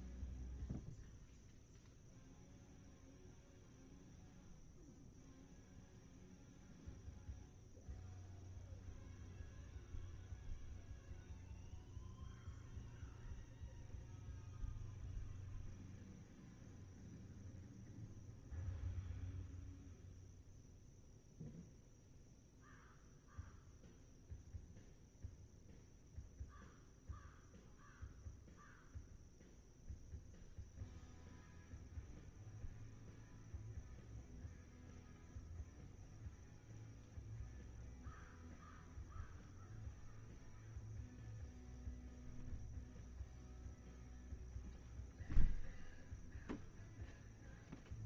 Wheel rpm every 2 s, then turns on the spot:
0, 0, 0, 0, 0, 0, 0, 0, 0, 0, 0, 0, 0, 0, 0, 0, 0, 0, 0, 0, 0, 0, 0, 0.
none